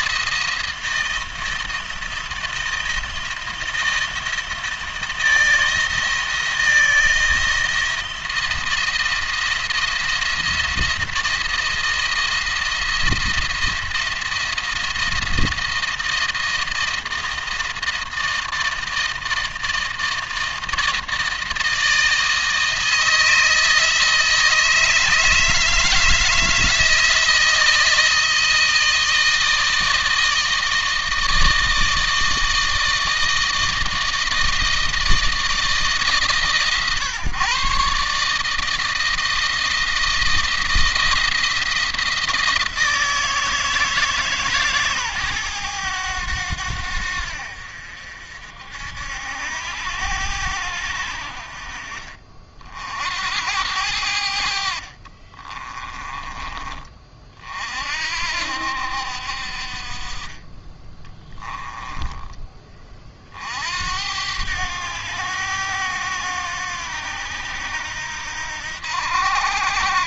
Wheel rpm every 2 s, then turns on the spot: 170, 170, 160, 160, 170, 170, 170, 170, 160, 160, 160, 160, 160, 160, 160, 160, 160, 160, 140, 160, 170, 170, 140, 90, 70, 90, 60, 60, 20, 70, 20, 30, 100, 90, 80.
54-56